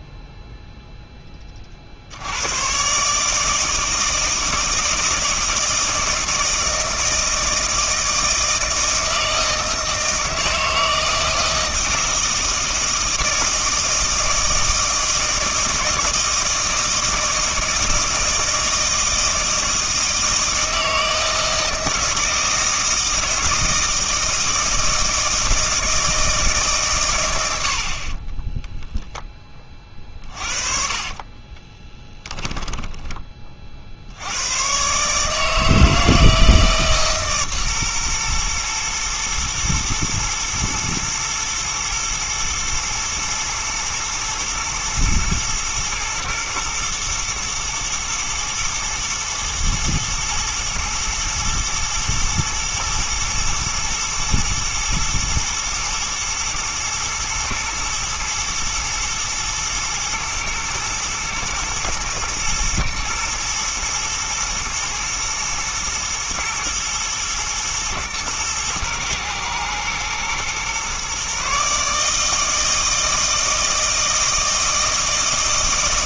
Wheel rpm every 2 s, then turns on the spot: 0, 130, 160, 160, 160, 160, 160, 160, 160, 160, 160, 160, 160, 150, 10, 40, 10, 130, 150, 120, 120, 110, 120, 120, 120, 120, 120, 110, 120, 120, 110, 120, 120, 120, 120, 130, 160, 160.
28-34